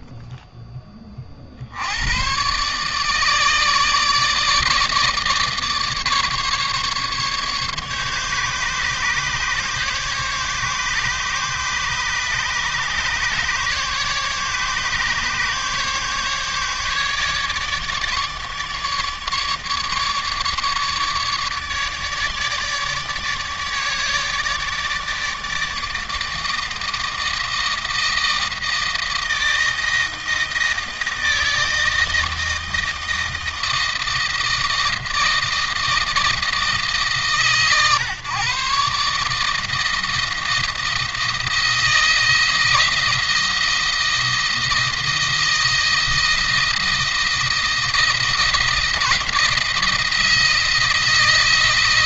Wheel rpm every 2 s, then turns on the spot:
10, 130, 160, 150, 140, 140, 140, 150, 150, 150, 150, 150, 150, 160, 160, 160, 160, 160, 160, 140, 160, 160, 160, 170, 170, 170.
none